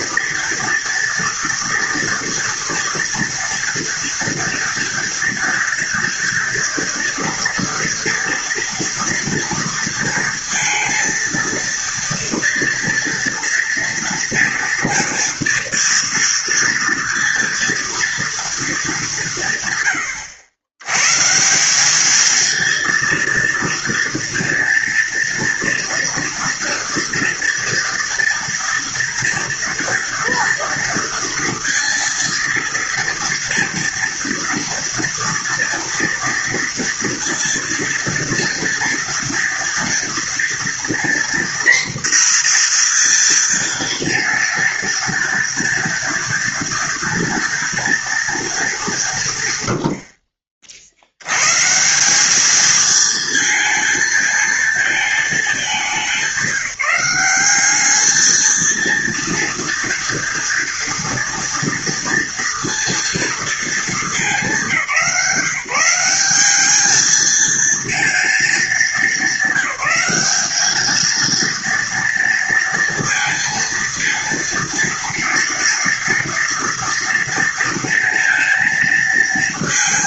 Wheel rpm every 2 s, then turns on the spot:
240, 240, 240, 230, 230, 230, 230, 240, 230, 210, 110, 230, 230, 230, 230, 230, 230, 230, 240, 230, 240, 240, 230, 230, 190, 70, 220, 220, 190, 220, 230, 230, 190, 210, 220, 220, 230, 230, 230, 230.
none